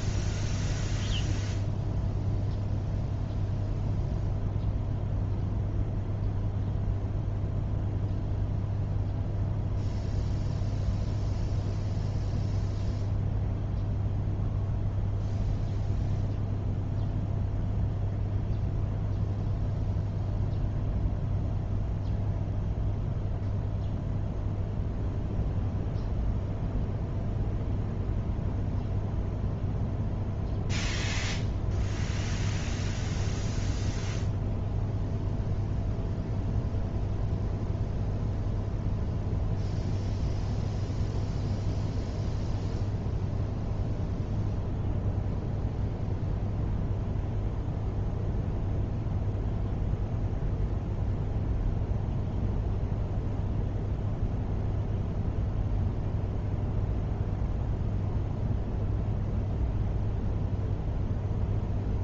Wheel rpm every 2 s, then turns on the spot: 0, 0, 0, 0, 0, 0, 0, 0, 0, 0, 0, 0, 0, 0, 0, 0, 0, 0, 0, 0, 0, 0, 0, 0, 0, 0, 0, 0, 0, 0, 0.
none